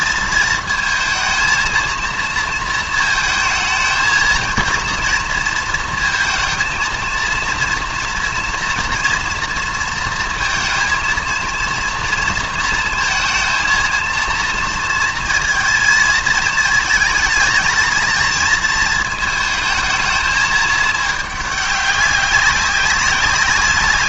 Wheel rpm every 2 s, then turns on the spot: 220, 230, 230, 220, 230, 230, 230, 230, 220, 220, 210, 190.
none